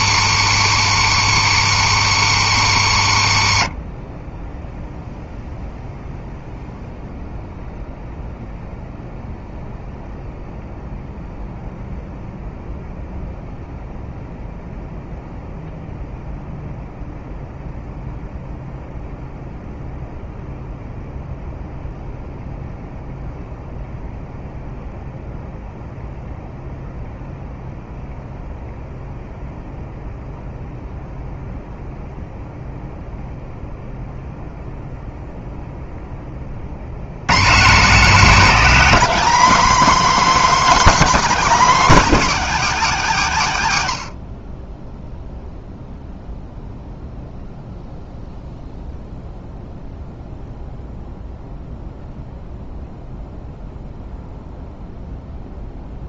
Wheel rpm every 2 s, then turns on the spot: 150, 110, 0, 0, 0, 0, 0, 0, 0, 0, 0, 0, 0, 0, 0, 0, 0, 0, 100, 270, 290, 230, 10, 0, 0, 0, 0, 0.
none